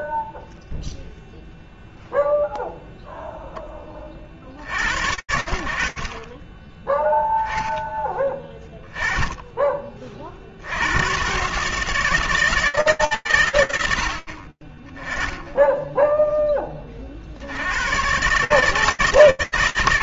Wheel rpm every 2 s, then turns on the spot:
0, 0, 70, 10, 10, 70, 150, 30, 40, 160.
none